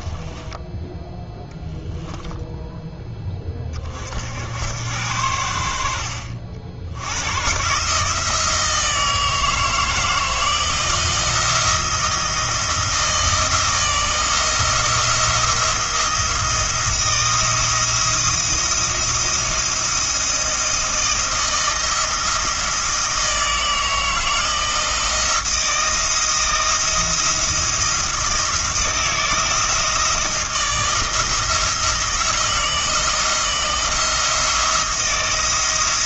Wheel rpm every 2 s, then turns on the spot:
10, 0, 80, 70, 160, 170, 170, 170, 170, 170, 170, 160, 160, 170, 170, 160, 170, 170.
none